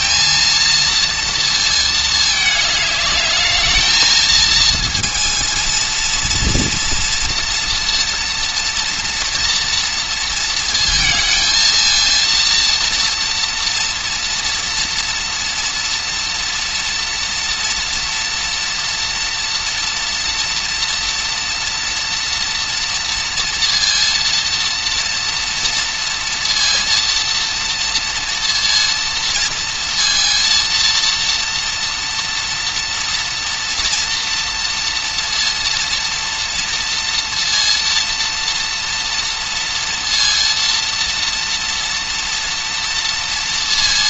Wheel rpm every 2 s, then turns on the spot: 230, 210, 230, 230, 230, 230, 230, 230, 230, 240, 240, 240, 230, 230, 230, 230, 230, 230, 230, 230, 230, 230.
none